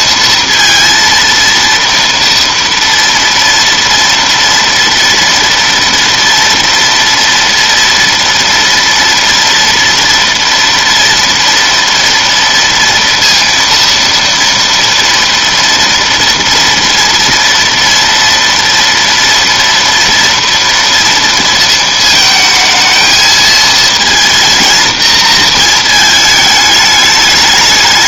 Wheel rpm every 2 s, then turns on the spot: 230, 230, 230, 230, 230, 230, 230, 230, 230, 230, 230, 220, 230, 210.
none